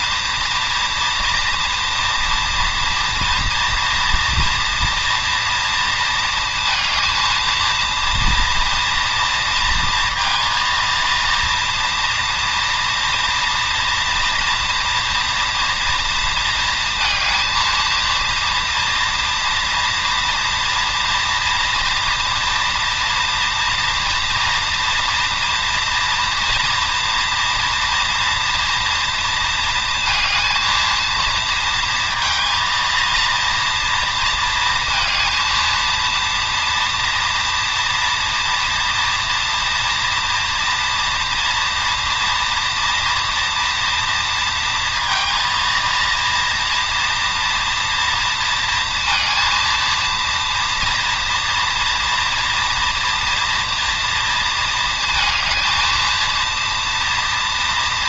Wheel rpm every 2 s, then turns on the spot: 230, 230, 240, 230, 230, 230, 230, 230, 220, 240, 230, 230, 230, 230, 230, 230, 230, 220, 230, 230, 230, 230, 220, 230, 230, 240, 230, 220, 230.
none